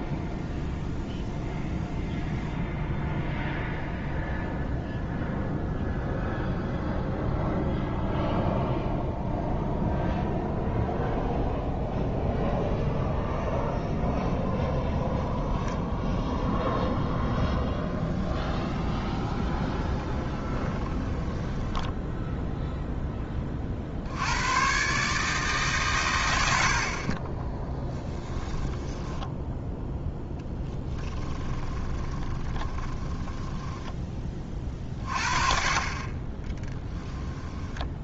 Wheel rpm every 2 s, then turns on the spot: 0, 0, 0, 0, 0, 0, 0, 0, 0, 20, 20, 0, 120, 60, 10, 10, 20, 30, 10.
18-22 30-34 36-38